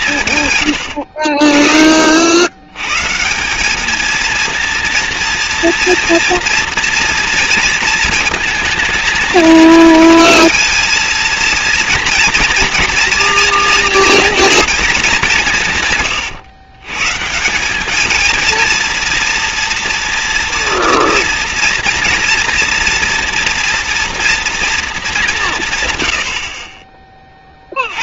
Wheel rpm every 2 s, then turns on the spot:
40, 180, 230, 230, 220, 230, 230, 190, 160, 240, 230, 240, 180, 20.
none